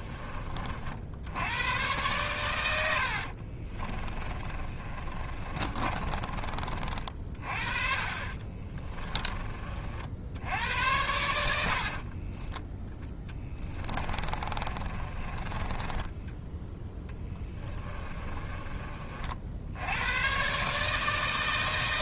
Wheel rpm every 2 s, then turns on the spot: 60, 80, 30, 40, 20, 90, 10, 30, 10, 40, 150.
2-6 8-10 14-16